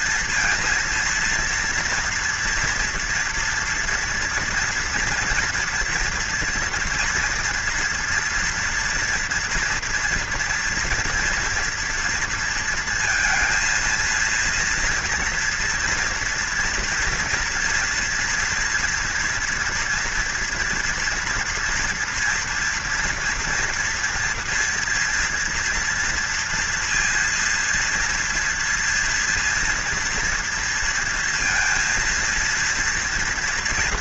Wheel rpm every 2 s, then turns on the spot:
230, 230, 240, 230, 230, 230, 230, 230, 240, 230, 240, 230, 230, 230, 230, 230, 230.
none